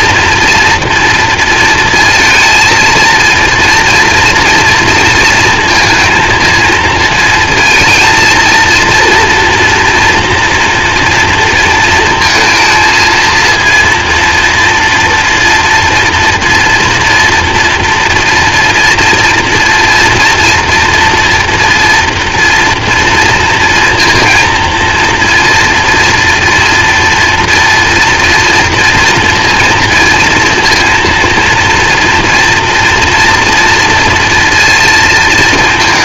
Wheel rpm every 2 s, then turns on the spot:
230, 230, 230, 230, 230, 230, 230, 240, 230, 230, 230, 230, 230, 230, 230, 230, 240, 230.
none